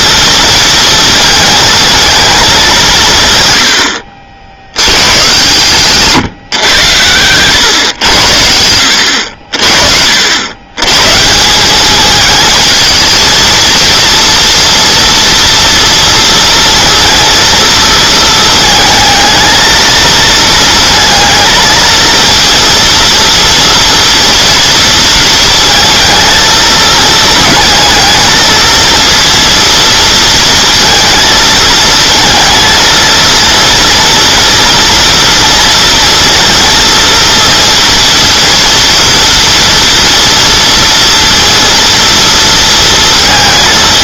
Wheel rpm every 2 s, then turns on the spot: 230, 190, 90, 120, 80, 110, 220, 230, 230, 220, 230, 240, 230, 220, 230, 230, 230, 240, 230, 230, 230, 230.
none